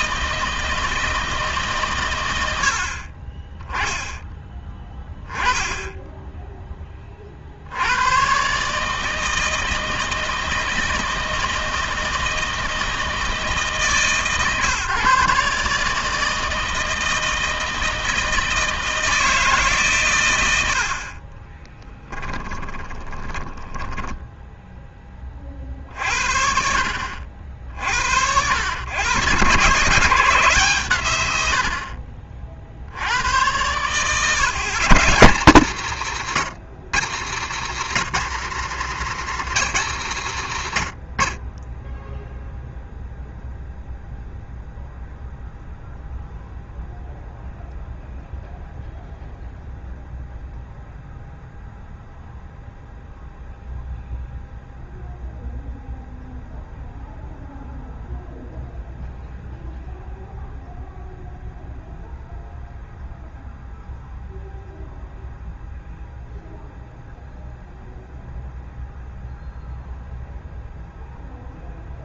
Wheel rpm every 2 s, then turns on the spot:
160, 80, 10, 10, 140, 160, 160, 140, 160, 160, 70, 20, 10, 60, 90, 120, 70, 140, 170, 200, 110, 0, 0, 0, 0, 0, 0, 0, 0, 0, 0, 0, 0, 0, 0, 0.
22-24